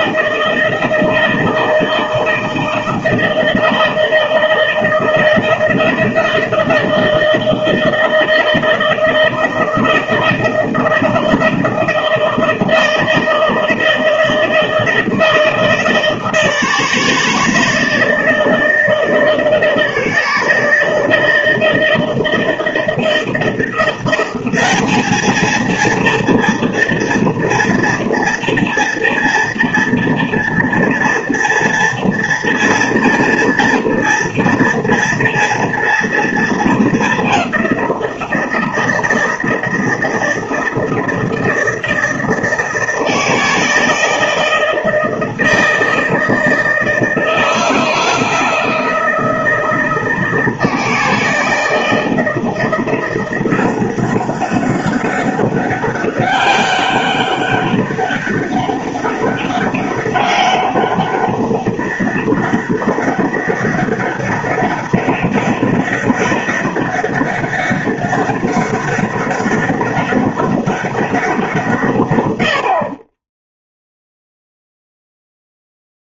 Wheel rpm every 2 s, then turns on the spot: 160, 160, 160, 160, 160, 160, 160, 160, 160, 160, 160, 160, 210, 230, 230, 230, 230, 230, 210, 160, 160, 160, 160, 160, 160, 160, 170, 190, 200, 190, 200, 200, 200, 200, 200, 200, 50, 0.
none